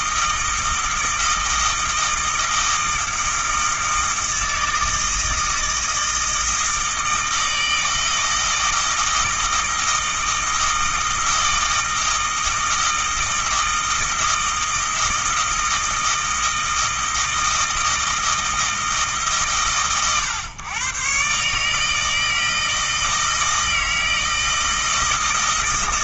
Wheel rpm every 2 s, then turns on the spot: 160, 160, 160, 160, 160, 160, 160, 160, 160, 160, 130, 160, 160.
none